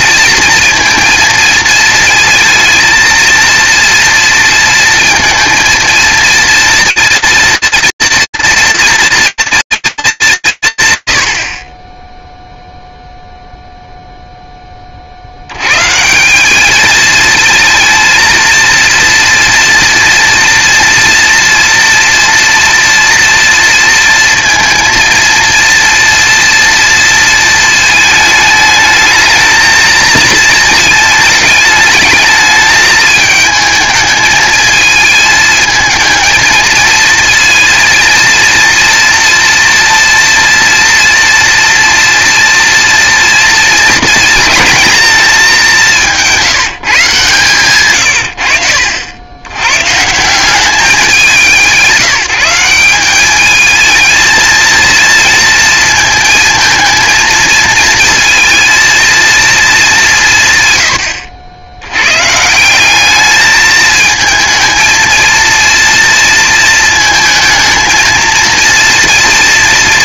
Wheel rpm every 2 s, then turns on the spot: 230, 230, 230, 230, 230, 140, 0, 30, 220, 230, 230, 230, 230, 230, 220, 220, 220, 220, 220, 230, 230, 230, 230, 140, 80, 200, 200, 230, 230, 230, 120, 200, 220, 230, 230.
none